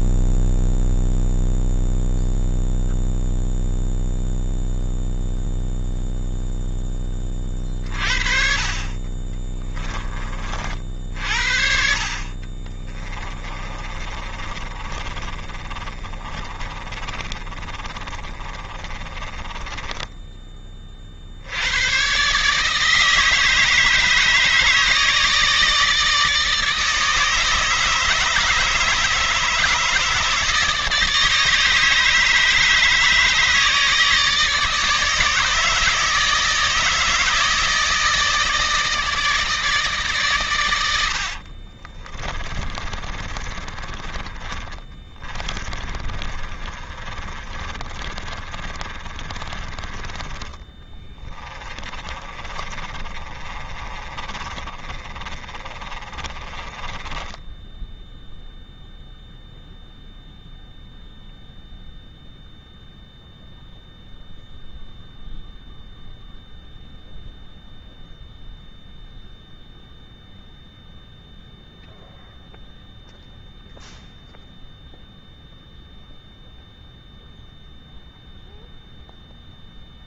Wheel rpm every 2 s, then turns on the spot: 0, 0, 0, 0, 40, 30, 40, 30, 40, 30, 20, 140, 160, 150, 150, 150, 150, 160, 160, 160, 130, 30, 20, 30, 30, 30, 30, 30, 30, 0, 0, 0, 0, 0, 0, 0, 0, 0, 0, 0.
12-20 42-50 52-58